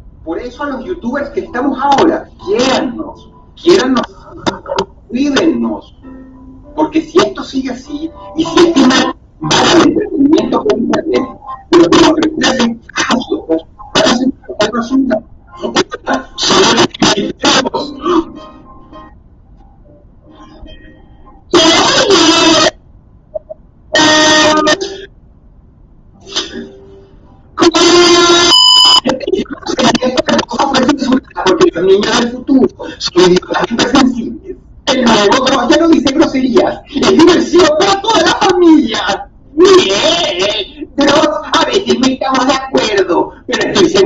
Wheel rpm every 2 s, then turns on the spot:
0, 0, 0, 0, 0, 0, 0, 0, 0, 0, 0, 0, 0, 0, 0, 0, 0, 0, 0, 0, 0, 0.
none